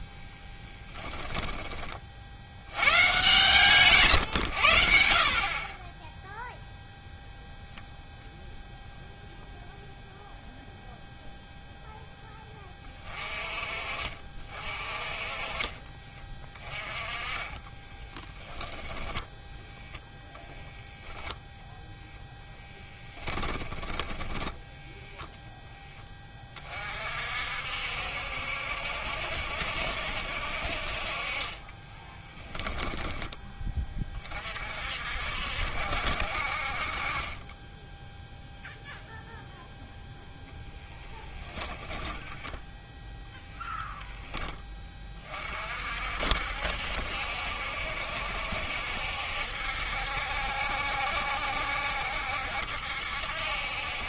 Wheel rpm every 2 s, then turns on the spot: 10, 110, 80, 0, 0, 0, 20, 30, 20, 10, 20, 10, 0, 40, 70, 50, 10, 50, 50, 0, 10, 0, 20, 70, 70, 70, 70.
0-2 20-24 40-42